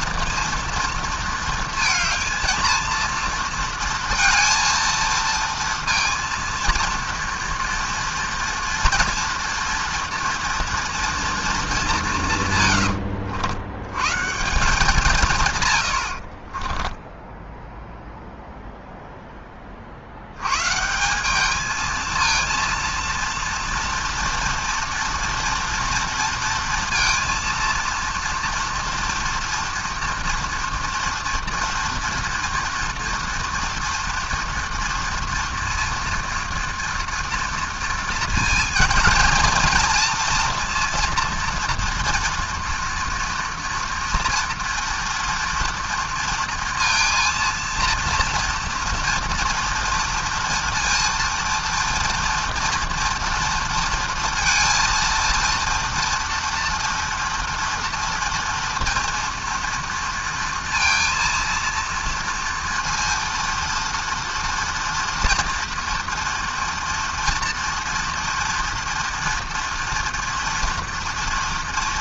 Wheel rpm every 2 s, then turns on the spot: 230, 230, 230, 230, 230, 230, 110, 160, 20, 0, 140, 230, 230, 230, 240, 230, 230, 240, 230, 230, 230, 230, 230, 230, 240, 230, 230, 230, 240, 230, 230, 230, 230, 230, 230, 230.
12-14 16-18